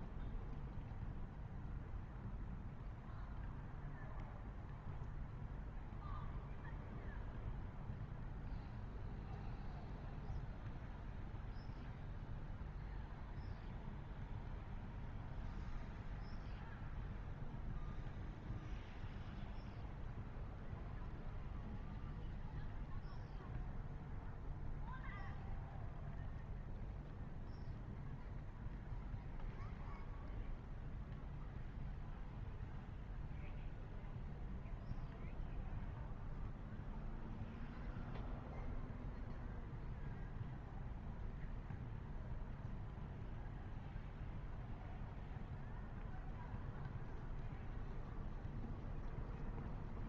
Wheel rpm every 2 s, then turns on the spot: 0, 0, 0, 0, 0, 0, 0, 0, 0, 0, 0, 0, 0, 0, 0, 0, 0, 0, 0, 0, 0, 0, 0, 0, 0.
none